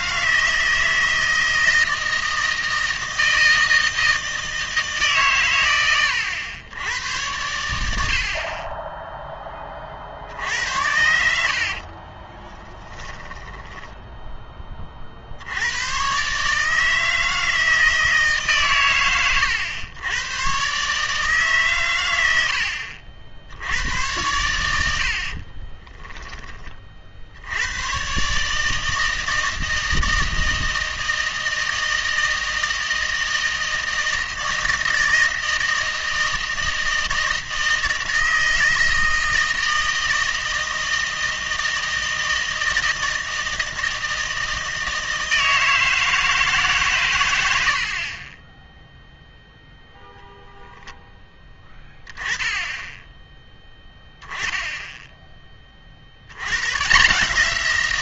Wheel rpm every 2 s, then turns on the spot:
160, 160, 160, 100, 30, 70, 10, 20, 150, 140, 130, 70, 100, 20, 150, 160, 160, 160, 160, 160, 160, 160, 160, 140, 10, 0, 10, 10, 130.
12-14